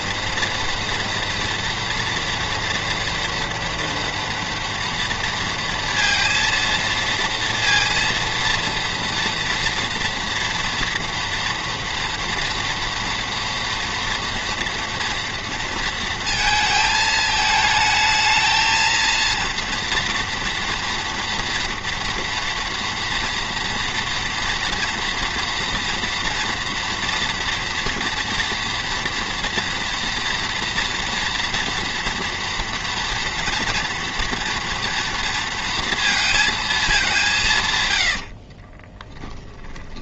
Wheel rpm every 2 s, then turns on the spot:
230, 230, 230, 230, 230, 230, 230, 230, 220, 230, 230, 230, 230, 230, 230, 240, 240, 240, 200, 20.
38-40